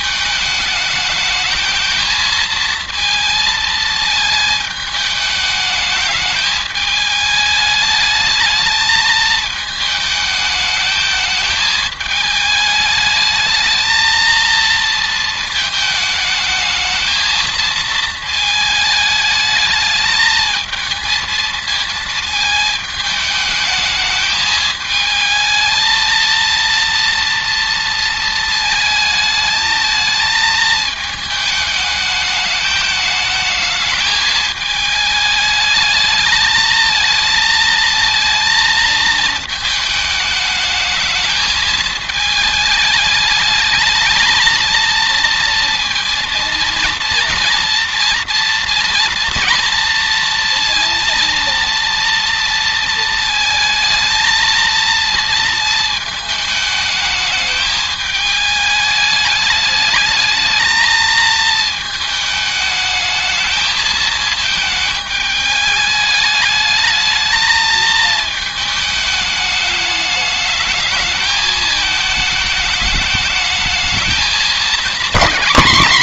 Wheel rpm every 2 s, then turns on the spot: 210, 230, 220, 210, 220, 210, 210, 230, 220, 220, 220, 220, 220, 230, 220, 220, 210, 210, 220, 220, 220, 220, 220, 230, 230, 230, 230, 230, 220, 210, 220, 210, 220, 210, 220, 220, 220, 210.
none